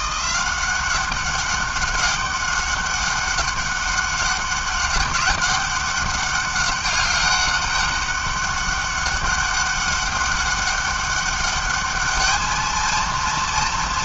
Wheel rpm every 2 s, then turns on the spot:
190, 200, 200, 200, 200, 200, 220.
none